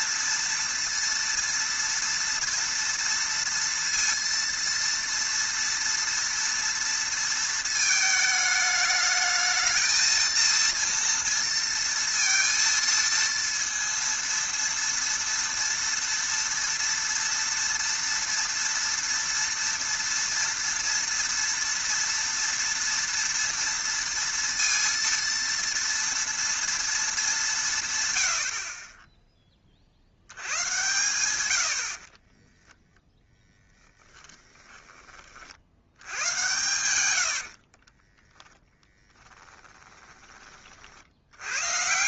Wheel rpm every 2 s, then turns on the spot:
230, 230, 230, 230, 210, 230, 230, 230, 230, 230, 230, 230, 230, 230, 50, 100, 10, 10, 110, 0, 30.
32-36